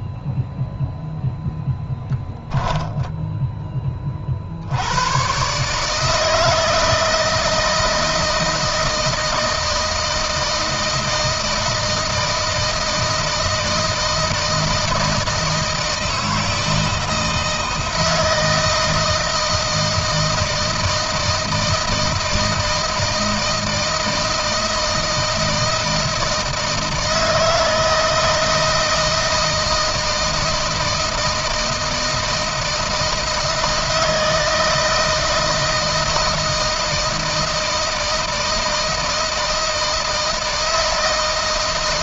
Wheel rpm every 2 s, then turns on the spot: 0, 10, 90, 160, 160, 160, 160, 160, 160, 160, 160, 160, 160, 160, 160, 160, 160, 160, 160, 160, 160.
2-4